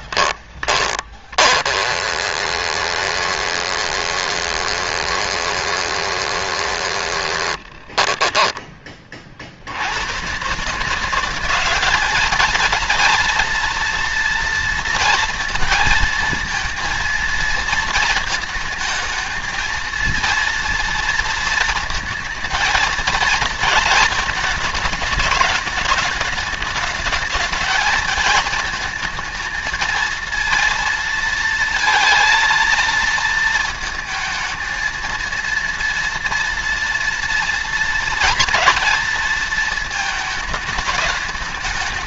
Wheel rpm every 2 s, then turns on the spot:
20, 20, 20, 20, 20, 170, 230, 230, 230, 220, 230, 220, 220, 220, 220, 230, 230, 230, 230, 230, 210.
0-8